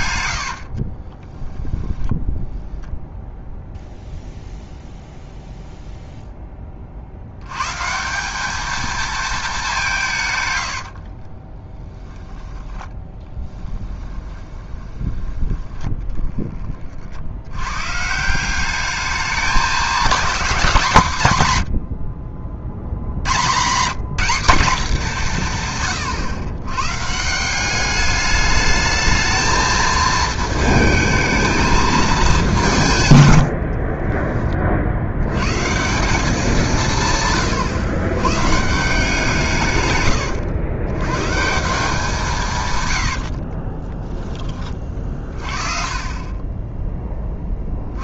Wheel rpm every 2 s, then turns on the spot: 70, 10, 0, 20, 210, 100, 20, 20, 20, 190, 190, 50, 210, 120, 210, 220, 180, 40, 180, 140, 80, 150, 20, 10.
0-2 10-16 46-48